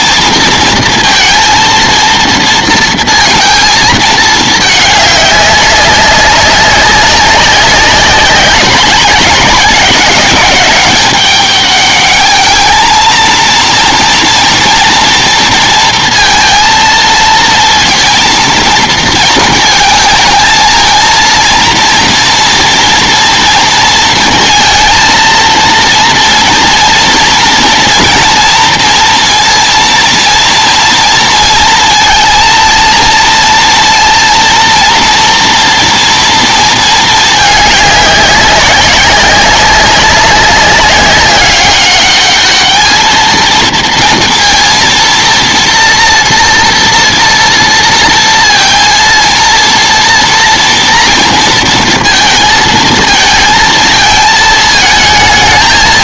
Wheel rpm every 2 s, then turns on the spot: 230, 230, 210, 200, 190, 200, 220, 230, 230, 230, 230, 230, 230, 230, 230, 230, 230, 230, 230, 190, 190, 220, 230, 230, 230, 240, 220, 220.
none